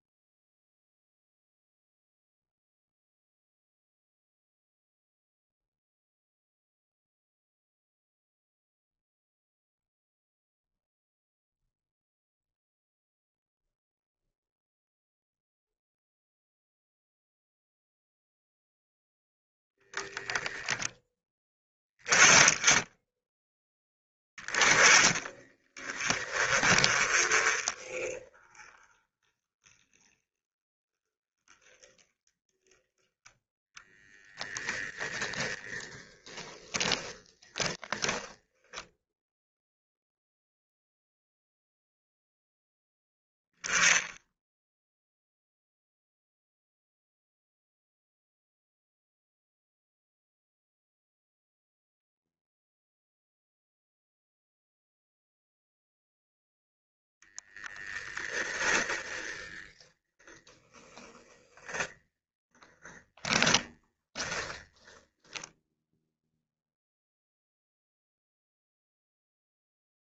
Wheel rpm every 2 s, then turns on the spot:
0, 0, 0, 0, 0, 0, 0, 0, 0, 0, 10, 10, 20, 20, 20, 20, 10, 0, 20, 0, 0, 0, 0, 0, 0, 0, 0, 0, 0, 10, 10, 10, 10, 0, 0.
36-38 62-64